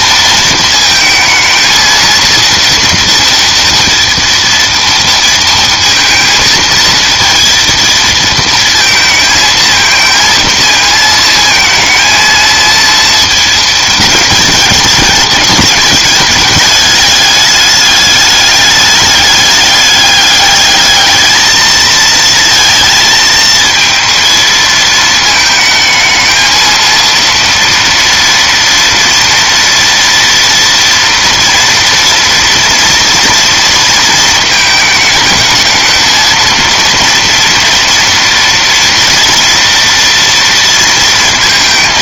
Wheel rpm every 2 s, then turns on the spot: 230, 230, 230, 230, 220, 230, 230, 210, 210, 210, 210, 230, 220, 220, 230, 230, 230, 220, 220, 230, 230.
none